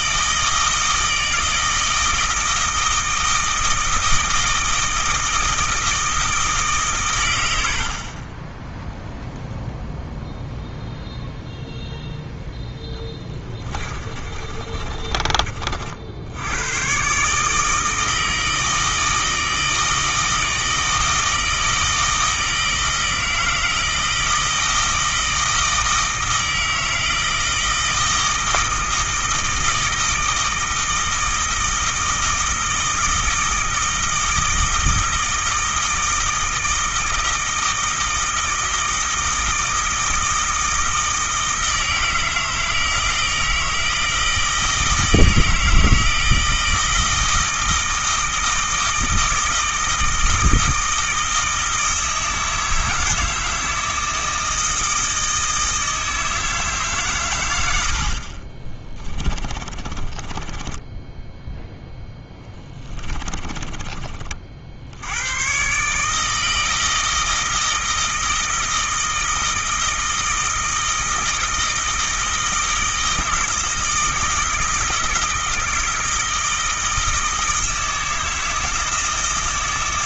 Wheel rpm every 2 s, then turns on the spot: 160, 160, 160, 140, 0, 0, 10, 30, 120, 160, 160, 160, 160, 160, 160, 160, 160, 160, 160, 160, 160, 160, 160, 160, 160, 160, 160, 160, 140, 20, 10, 20, 70, 160, 160, 160, 160, 160, 160, 160.
12-16 58-64